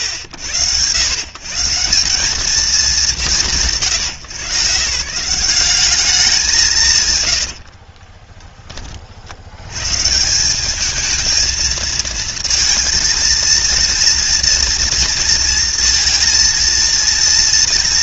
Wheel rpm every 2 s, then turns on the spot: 120, 200, 150, 180, 20, 180, 230, 230, 230.
none